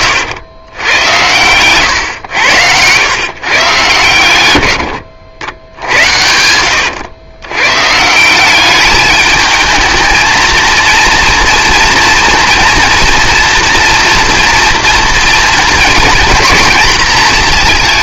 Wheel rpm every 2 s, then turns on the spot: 100, 100, 110, 90, 170, 220, 230, 230, 230.
6-8